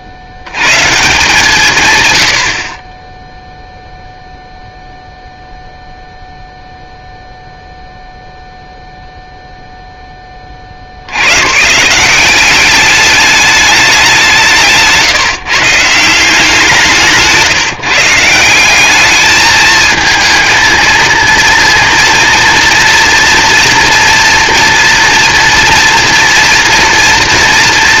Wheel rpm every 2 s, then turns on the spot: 110, 30, 0, 0, 0, 50, 200, 170, 170, 190, 220, 230, 230, 230.
14-16